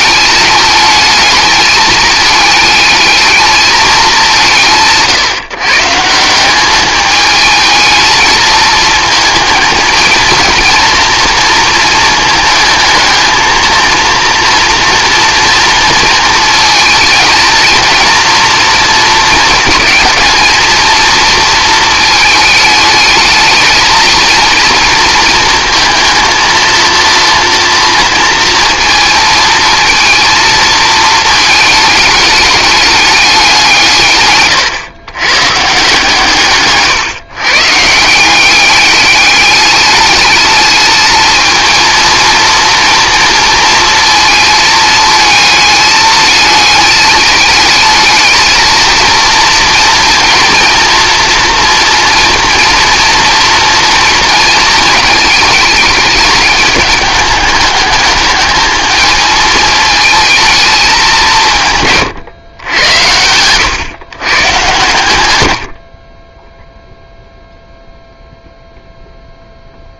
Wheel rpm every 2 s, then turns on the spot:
210, 210, 160, 200, 220, 230, 220, 230, 220, 230, 220, 220, 230, 230, 220, 220, 210, 120, 140, 200, 210, 230, 220, 220, 230, 230, 230, 220, 210, 220, 210, 100, 120, 0, 0.
none